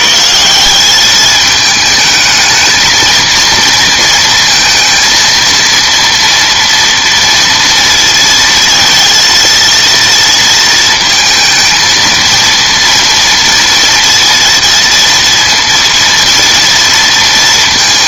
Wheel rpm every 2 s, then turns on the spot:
170, 220, 230, 230, 230, 230, 230, 230, 230.
none